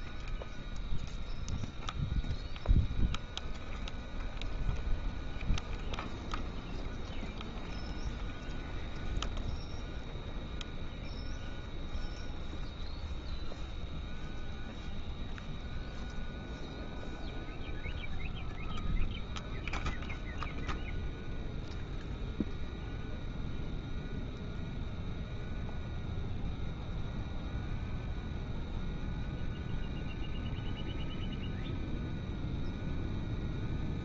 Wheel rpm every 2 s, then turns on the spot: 0, 0, 0, 0, 0, 0, 0, 0, 0, 0, 0, 0, 0, 0, 0, 0, 0.
none